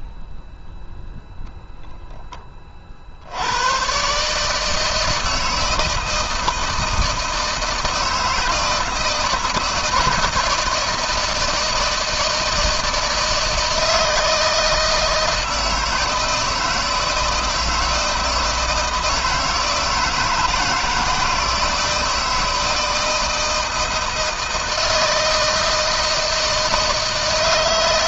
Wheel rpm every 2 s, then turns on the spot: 0, 30, 150, 160, 160, 160, 160, 160, 160, 160, 160, 160, 160, 160.
none